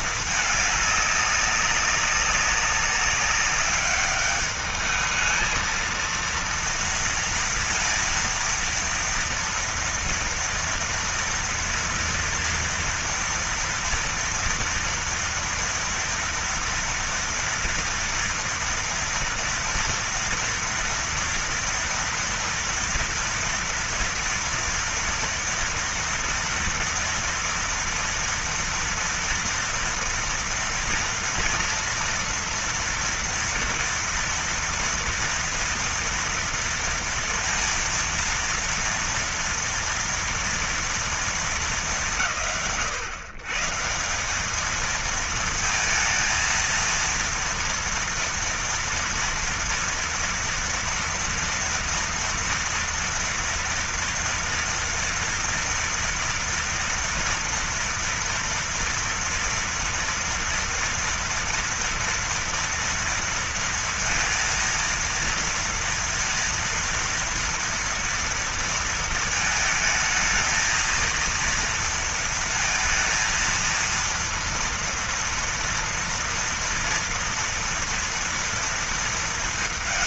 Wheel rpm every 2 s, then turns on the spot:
210, 200, 210, 230, 230, 230, 230, 230, 230, 230, 230, 230, 230, 230, 230, 230, 230, 230, 230, 230, 240, 110, 210, 230, 230, 230, 230, 230, 230, 230, 230, 230, 230, 230, 230, 230, 230, 230, 230, 230.
none